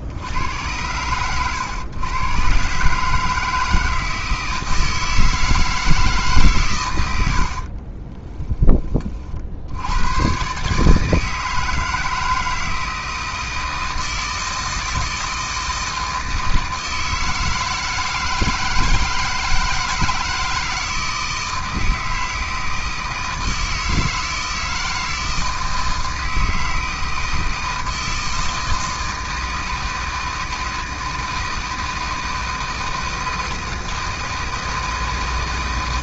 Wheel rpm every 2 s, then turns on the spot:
90, 140, 160, 120, 20, 140, 160, 160, 160, 160, 160, 160, 160, 160, 160, 160, 160, 160.
none